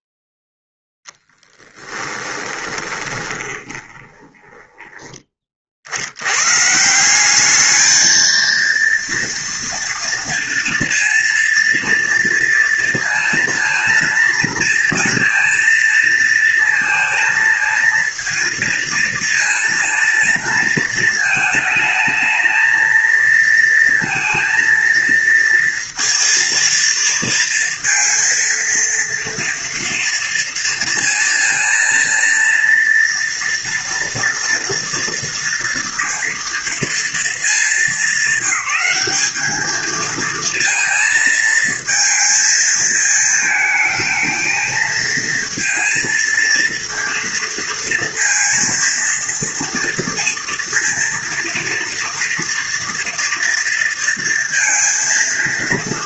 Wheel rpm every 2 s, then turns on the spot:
0, 20, 20, 180, 230, 230, 230, 230, 230, 230, 230, 230, 230, 230, 230, 230, 230, 230, 220, 200, 230, 220, 230, 230, 230, 230, 240, 230.
2-4